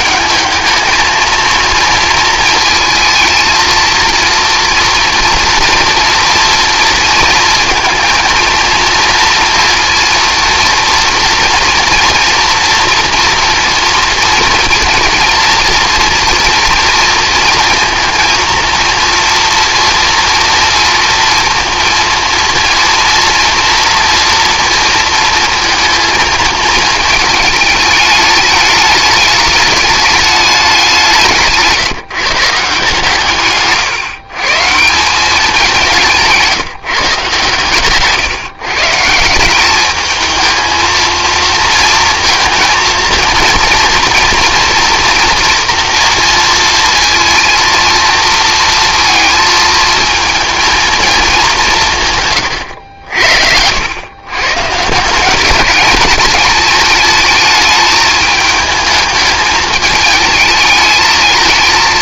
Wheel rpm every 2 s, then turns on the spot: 220, 230, 230, 230, 230, 230, 240, 230, 230, 230, 230, 230, 230, 220, 210, 200, 150, 170, 160, 140, 220, 230, 230, 230, 230, 230, 130, 130, 210, 210, 220.
none